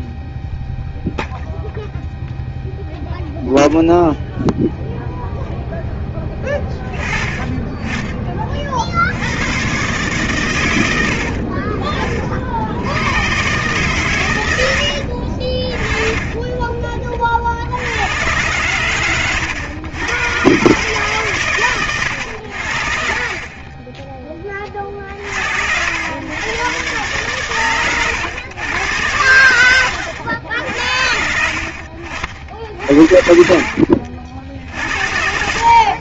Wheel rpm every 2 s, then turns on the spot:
0, 0, 0, 20, 50, 90, 80, 70, 30, 110, 140, 50, 50, 120, 110, 60, 60, 70.
32-36